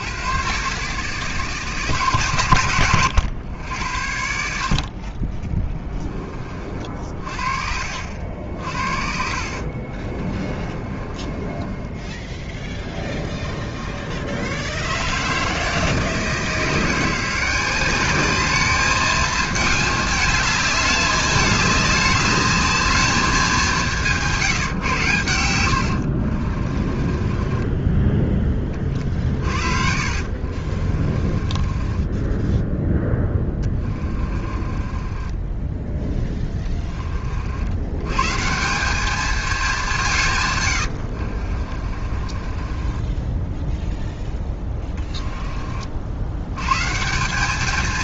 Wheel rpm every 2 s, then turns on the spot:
130, 110, 60, 30, 60, 30, 10, 60, 160, 210, 210, 210, 160, 40, 20, 50, 10, 30, 20, 170, 120, 30, 10, 110.
10-14 26-28 30-36 40-46